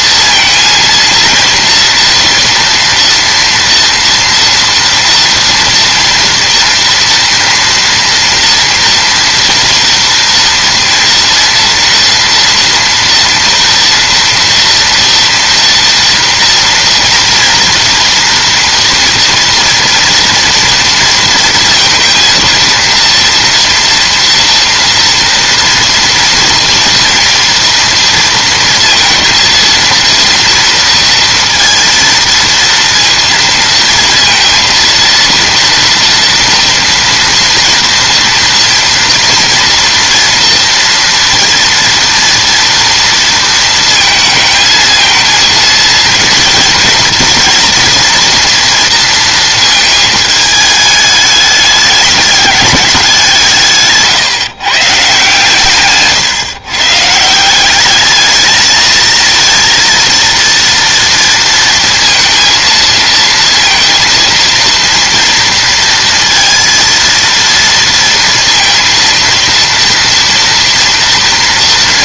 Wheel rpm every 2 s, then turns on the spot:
230, 230, 230, 230, 230, 230, 230, 230, 230, 230, 230, 230, 240, 230, 220, 230, 230, 230, 230, 240, 230, 230, 220, 230, 230, 210, 200, 150, 140, 220, 230, 230, 230, 230, 230, 230.
none